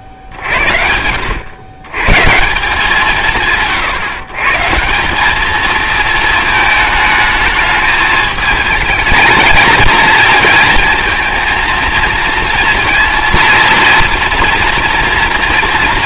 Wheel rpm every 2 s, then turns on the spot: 60, 160, 140, 220, 220, 230, 230, 230.
none